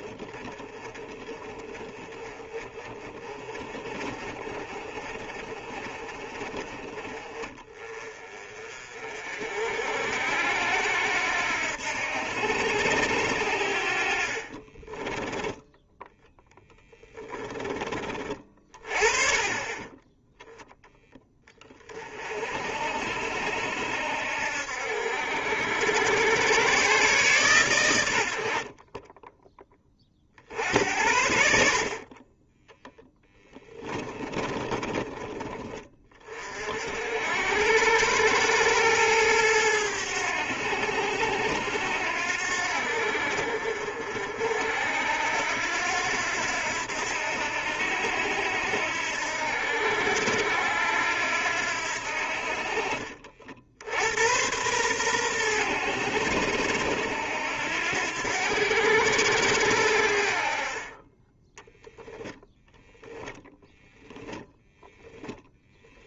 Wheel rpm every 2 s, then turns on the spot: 20, 30, 40, 30, 40, 80, 80, 30, 10, 30, 10, 60, 60, 120, 40, 70, 10, 20, 60, 110, 80, 70, 70, 90, 80, 80, 50, 110, 80, 90, 30, 0, 0.
14-20 32-36